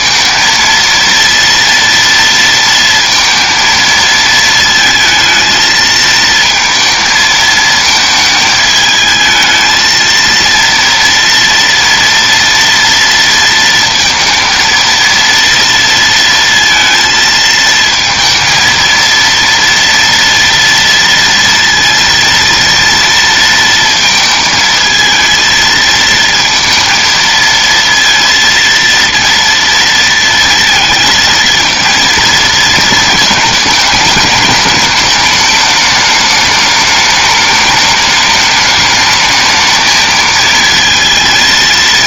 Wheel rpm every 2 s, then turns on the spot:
230, 230, 220, 220, 220, 240, 230, 230, 230, 230, 230, 230, 220, 230, 230, 230, 220, 210, 210, 210, 220.
none